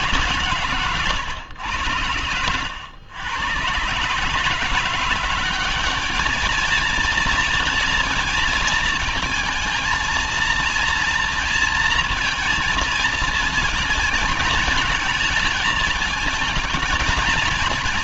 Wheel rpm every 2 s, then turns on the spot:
130, 90, 150, 220, 230, 230, 230, 230, 220.
none